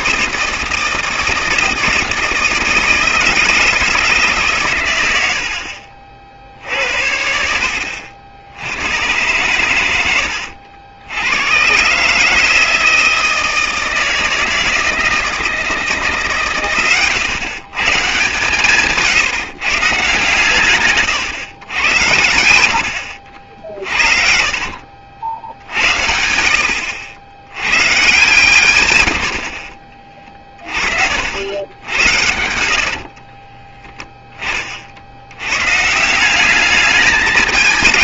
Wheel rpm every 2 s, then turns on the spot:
160, 160, 110, 70, 100, 80, 160, 160, 120, 150, 130, 80, 50, 80, 100, 40, 70, 40, 210.
24-26 32-34